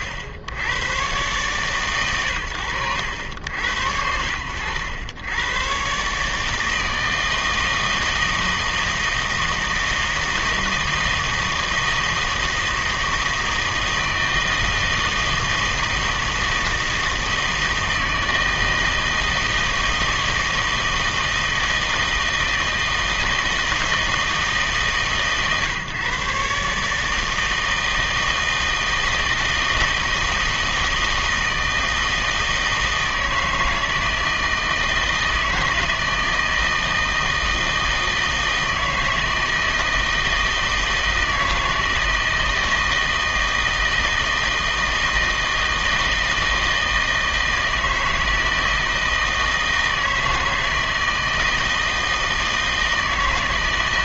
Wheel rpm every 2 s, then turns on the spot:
60, 80, 90, 160, 160, 160, 160, 160, 160, 160, 160, 160, 150, 140, 160, 160, 160, 160, 160, 160, 160, 160, 160, 160, 160, 160, 160.
none